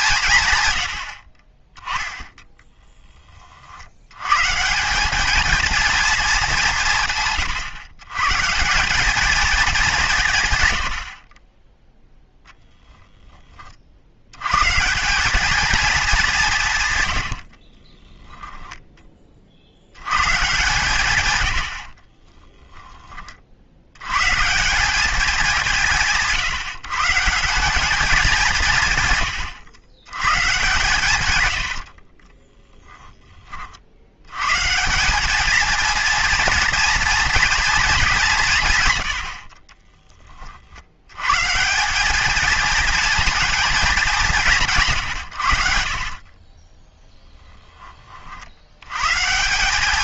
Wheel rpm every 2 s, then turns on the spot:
120, 10, 160, 180, 170, 110, 0, 130, 160, 10, 140, 10, 150, 170, 170, 130, 10, 130, 230, 160, 50, 220, 180, 30, 80.
32-34 46-48